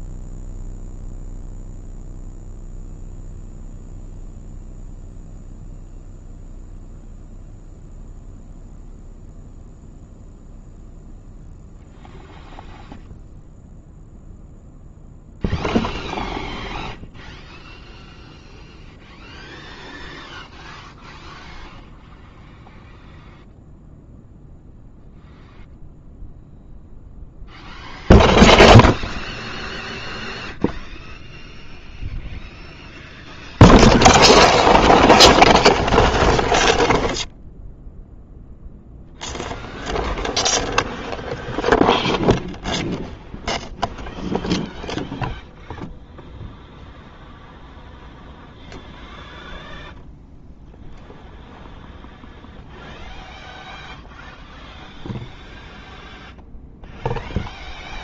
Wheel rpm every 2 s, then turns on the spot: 0, 0, 0, 0, 0, 0, 0, 0, 0, 0, 0, 0, 0, 0, 0, 0, 0, 0, 0, 0, 0, 0, 0, 0, 0, 0, 0, 0, 0.
none